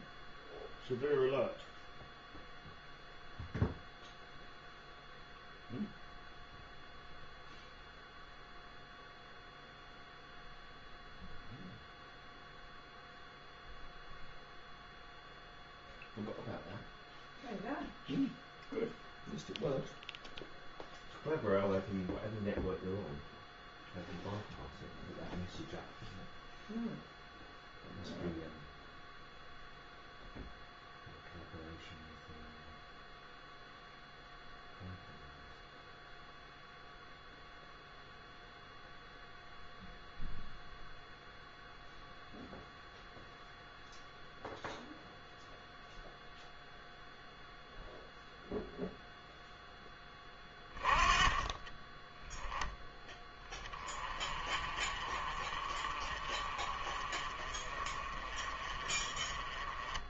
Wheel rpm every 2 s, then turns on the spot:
0, 0, 0, 0, 0, 0, 0, 0, 0, 0, 0, 0, 0, 0, 0, 0, 0, 0, 0, 0, 0, 0, 0, 0, 0, 20, 10, 40, 30, 30.
none